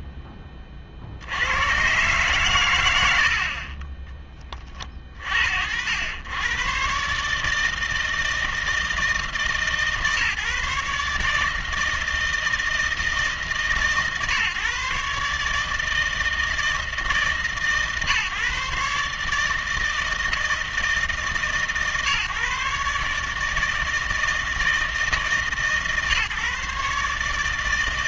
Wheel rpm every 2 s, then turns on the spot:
30, 100, 40, 130, 160, 150, 160, 140, 160, 140, 160, 150, 160, 140.
none